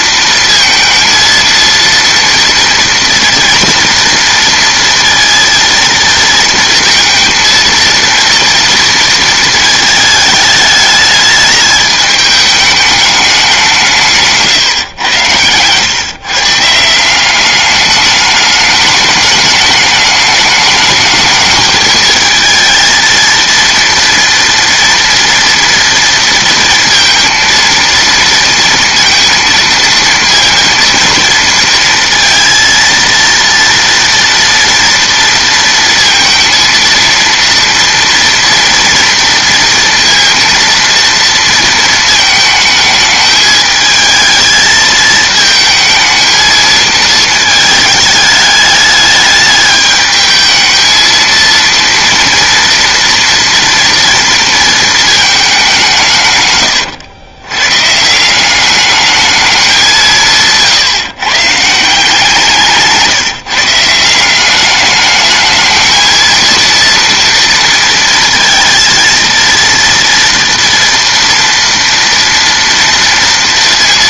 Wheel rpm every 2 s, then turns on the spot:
230, 230, 230, 230, 230, 210, 210, 140, 160, 210, 210, 220, 230, 230, 230, 230, 230, 230, 230, 230, 230, 220, 220, 220, 210, 220, 230, 220, 120, 200, 150, 160, 200, 230, 230, 230, 230.
none